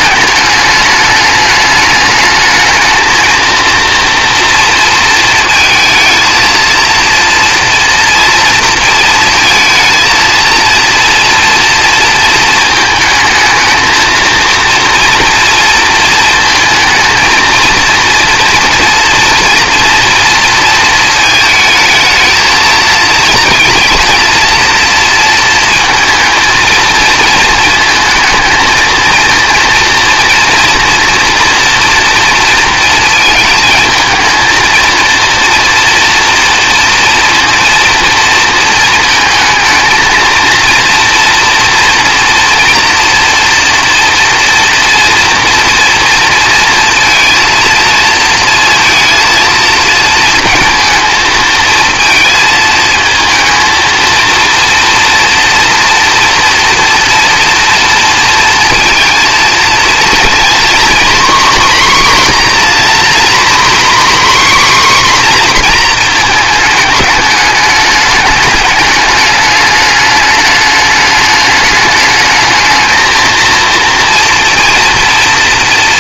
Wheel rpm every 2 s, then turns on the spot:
210, 220, 230, 230, 230, 230, 220, 230, 230, 230, 220, 220, 230, 220, 220, 230, 230, 230, 230, 220, 230, 230, 230, 230, 230, 230, 220, 230, 230, 230, 240, 250, 270, 220, 210, 210, 220, 230.
none